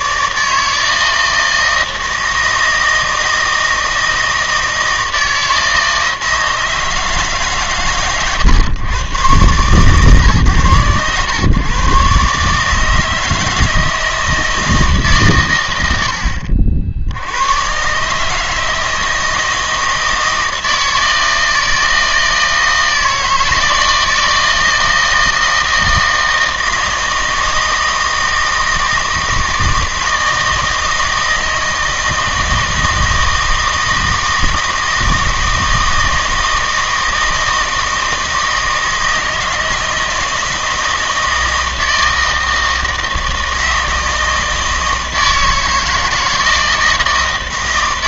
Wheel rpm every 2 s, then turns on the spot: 160, 160, 160, 160, 120, 120, 150, 160, 70, 160, 160, 160, 160, 160, 160, 160, 160, 160, 160, 160, 160, 160, 160, 160.
none